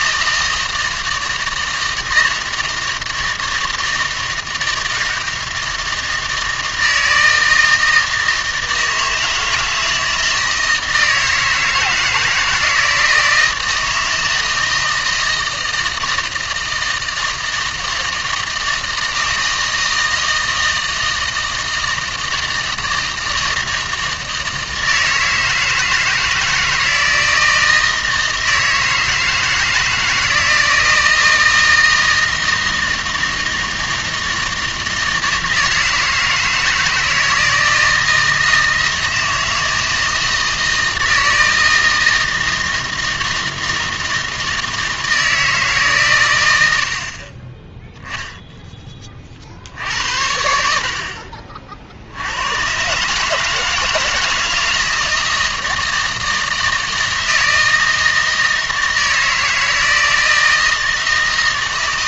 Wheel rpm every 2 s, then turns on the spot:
160, 160, 160, 160, 160, 160, 160, 160, 160, 160, 160, 160, 160, 160, 160, 170, 160, 170, 160, 160, 160, 160, 160, 70, 10, 70, 130, 170, 160, 160, 160.
none